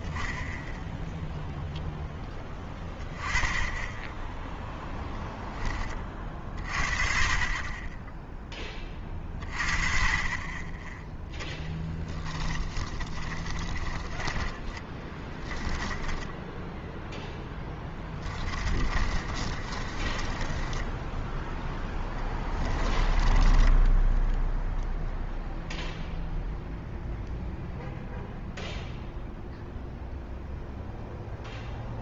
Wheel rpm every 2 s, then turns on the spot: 0, 10, 10, 40, 10, 20, 20, 20, 0, 30, 20, 20, 0, 0, 0, 0.
12-14 18-24